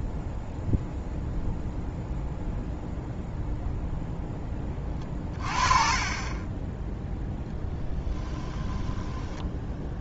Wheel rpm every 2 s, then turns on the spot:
0, 0, 20, 10, 10.
8-10